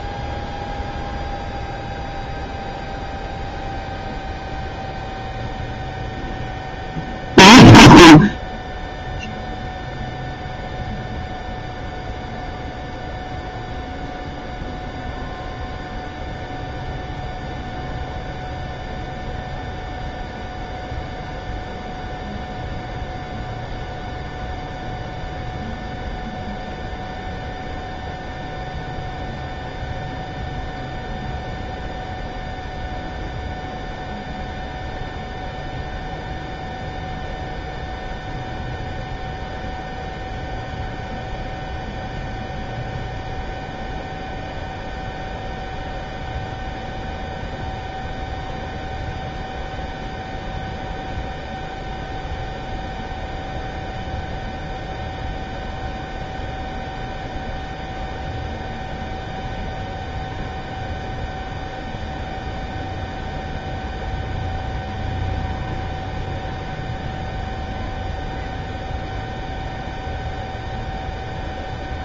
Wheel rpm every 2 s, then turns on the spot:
0, 0, 0, 0, 0, 0, 0, 0, 0, 0, 0, 0, 0, 0, 0, 0, 0, 0, 0, 0, 0, 0, 0, 0, 0, 0, 0, 0, 0, 0, 0, 0, 0, 0, 0, 0.
none